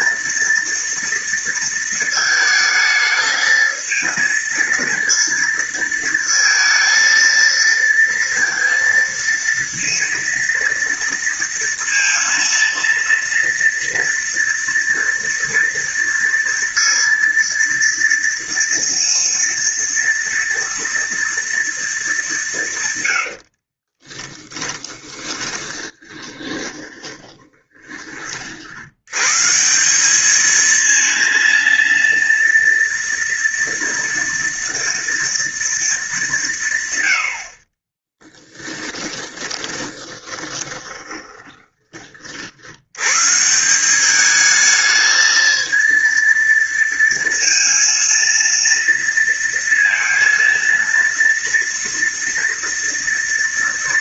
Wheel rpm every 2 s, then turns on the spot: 230, 220, 230, 230, 230, 230, 230, 230, 230, 230, 230, 140, 30, 20, 70, 220, 230, 230, 90, 10, 10, 90, 220, 230, 230, 230, 230.
24-28 38-42